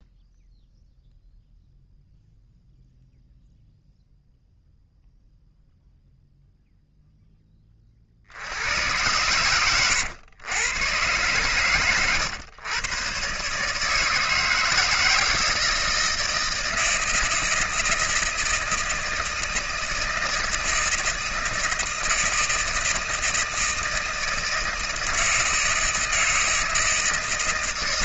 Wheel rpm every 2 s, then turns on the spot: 0, 0, 0, 0, 80, 110, 110, 160, 160, 160, 160, 160, 160, 160.
none